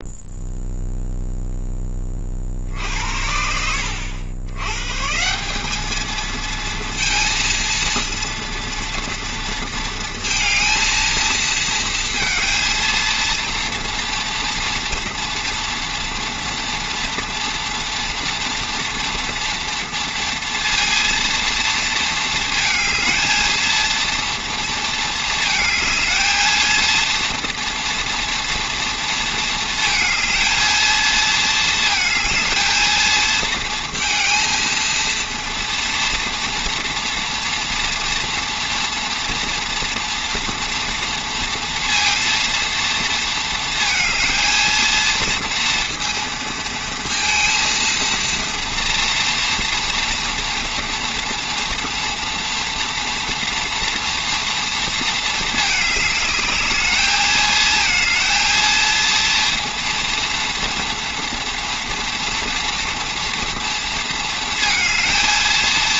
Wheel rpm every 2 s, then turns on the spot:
0, 50, 110, 230, 230, 230, 230, 230, 230, 230, 230, 220, 230, 230, 230, 220, 230, 230, 230, 230, 230, 230, 220, 230, 230, 230, 240, 230, 210, 230, 230, 230, 230.
none